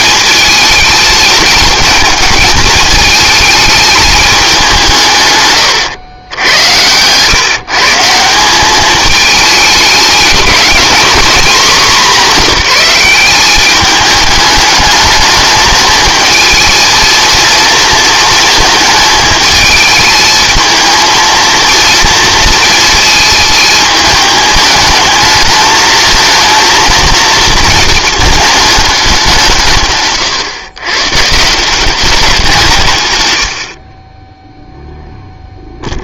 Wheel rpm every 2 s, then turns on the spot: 220, 220, 180, 90, 200, 230, 200, 210, 220, 220, 220, 230, 220, 230, 220, 130, 160, 0.
none